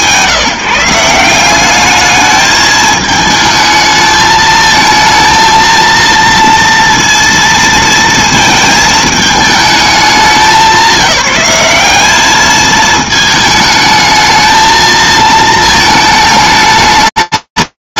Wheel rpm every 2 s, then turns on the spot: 170, 210, 220, 230, 230, 200, 210, 220, 220.
none